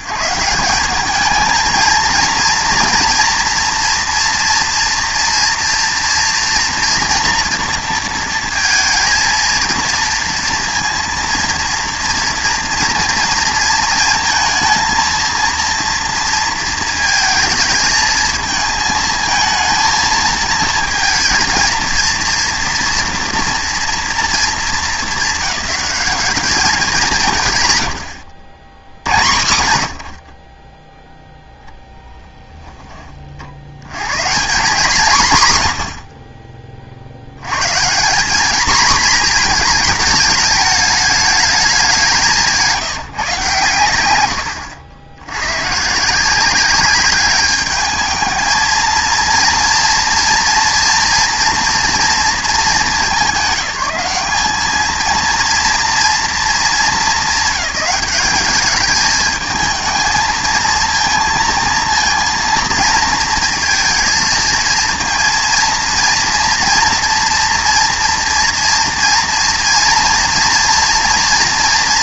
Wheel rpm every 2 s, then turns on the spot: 160, 240, 240, 230, 230, 230, 230, 230, 230, 220, 230, 230, 200, 200, 70, 20, 10, 160, 70, 230, 210, 160, 80, 200, 220, 230, 210, 210, 220, 210, 230, 230, 230, 230, 230, 230.
none